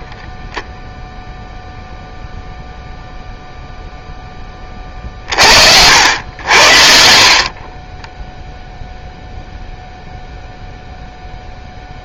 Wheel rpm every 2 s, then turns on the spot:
0, 0, 30, 50, 0, 0.
none